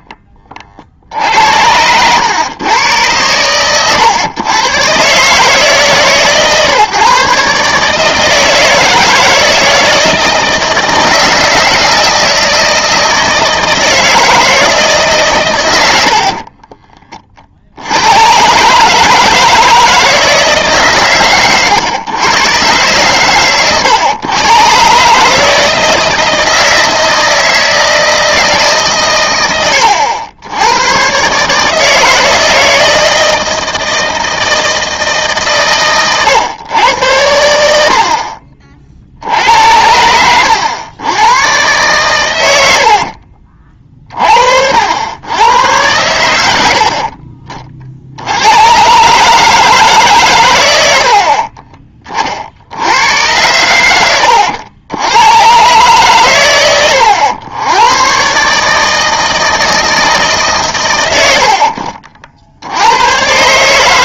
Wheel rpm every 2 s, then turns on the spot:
40, 110, 120, 140, 160, 160, 160, 160, 40, 140, 150, 130, 130, 160, 150, 100, 160, 160, 100, 50, 100, 90, 60, 70, 110, 100, 70, 80, 110, 150, 130, 90.
16-18